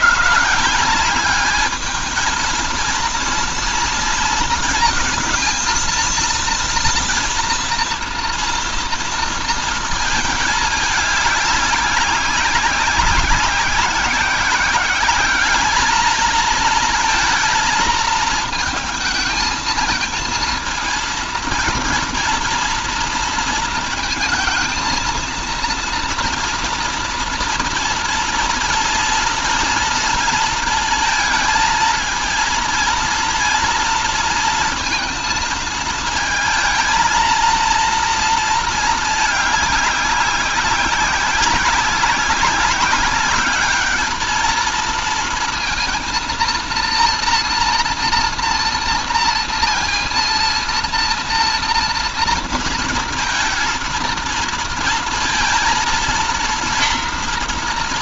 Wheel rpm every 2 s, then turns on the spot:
170, 230, 230, 230, 230, 210, 190, 200, 220, 220, 230, 230, 220, 230, 230, 220, 230, 230, 230, 220, 190, 200, 220, 230, 230, 230, 230, 230, 230.
none